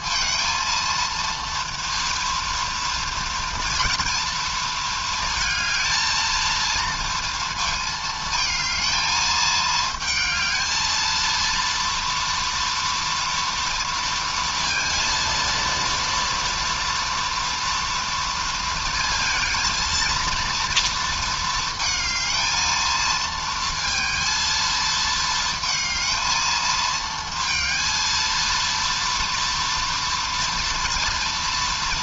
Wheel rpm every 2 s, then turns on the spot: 230, 230, 230, 230, 220, 220, 230, 230, 230, 230, 230, 220, 230, 220, 230, 230.
none